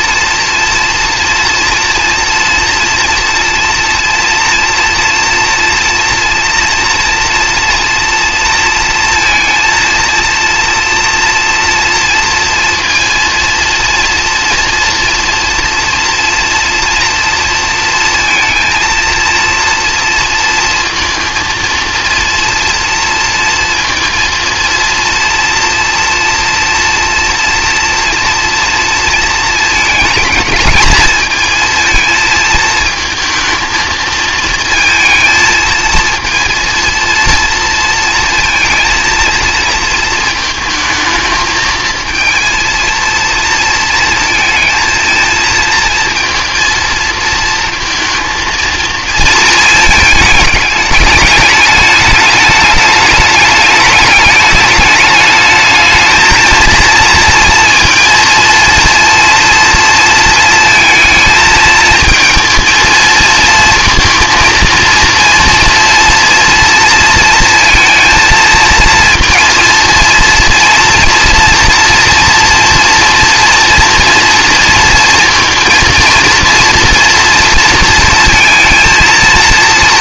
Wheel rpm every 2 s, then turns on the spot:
230, 230, 240, 240, 230, 230, 230, 240, 230, 230, 230, 230, 230, 230, 230, 220, 220, 220, 230, 220, 220, 230, 220, 230, 230, 210, 210, 210, 230, 230, 230, 230, 230, 230, 230, 230, 230, 230, 230, 230.
none